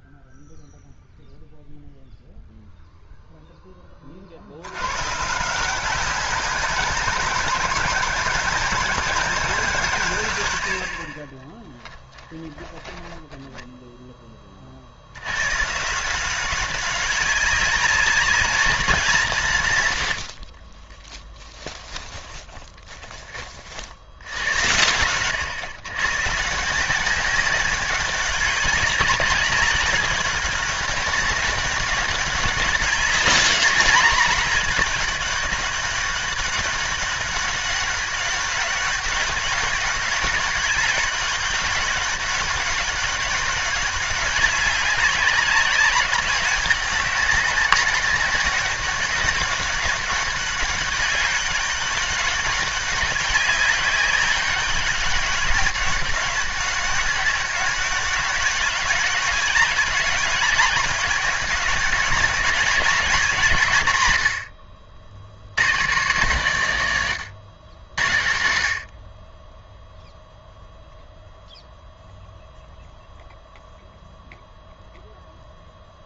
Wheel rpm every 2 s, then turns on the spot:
0, 0, 80, 190, 200, 100, 10, 40, 190, 200, 40, 30, 90, 160, 200, 200, 200, 200, 200, 190, 200, 200, 200, 200, 190, 200, 200, 200, 200, 210, 200, 200, 80, 140, 70, 0, 0, 0.
12-14 20-24